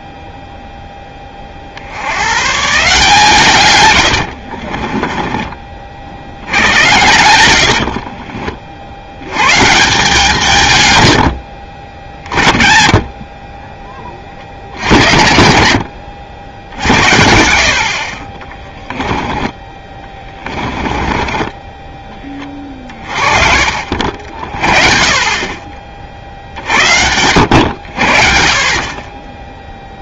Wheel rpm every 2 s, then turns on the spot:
10, 140, 40, 90, 70, 120, 30, 70, 70, 20, 20, 30, 40, 70, 40.
4-6 16-22